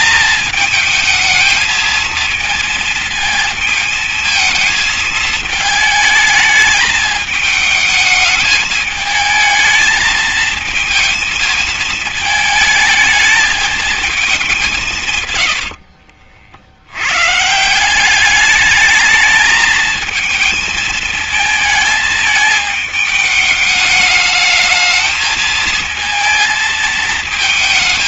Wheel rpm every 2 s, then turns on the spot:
220, 230, 220, 220, 210, 220, 220, 190, 70, 210, 220, 210, 220, 230.
none